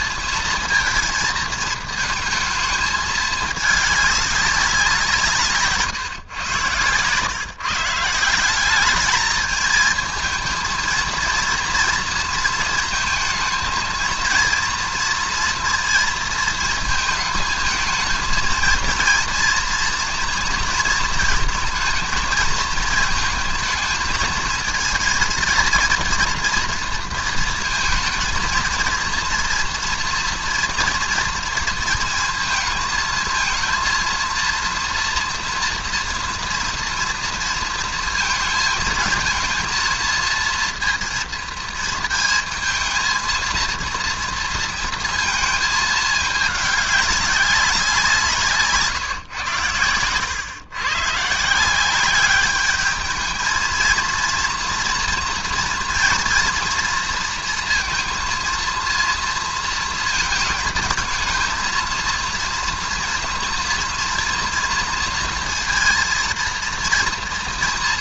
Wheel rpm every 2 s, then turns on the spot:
230, 220, 190, 120, 180, 220, 230, 230, 220, 230, 230, 220, 220, 230, 230, 240, 220, 230, 230, 230, 230, 220, 230, 210, 160, 110, 200, 230, 230, 230, 220, 230, 230, 230.
none